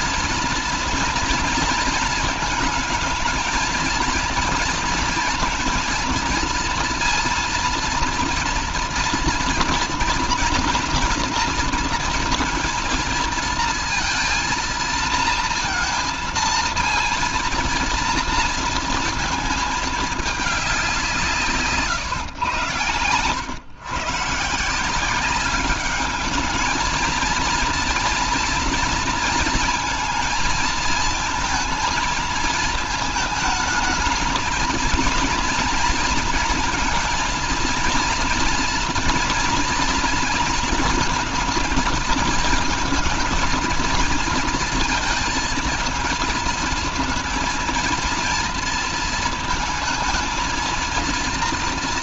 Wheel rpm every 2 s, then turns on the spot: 230, 230, 230, 230, 230, 230, 230, 230, 230, 230, 200, 120, 170, 220, 230, 230, 220, 230, 230, 230, 230, 230, 230, 230, 230, 230.
22-24